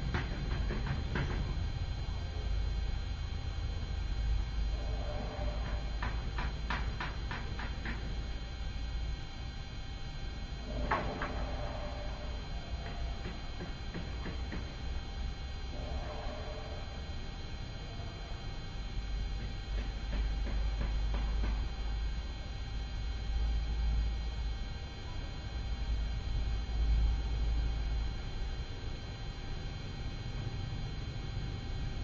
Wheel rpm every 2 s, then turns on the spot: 0, 0, 0, 0, 0, 0, 0, 0, 0, 0, 0, 0, 0, 0, 0, 0.
none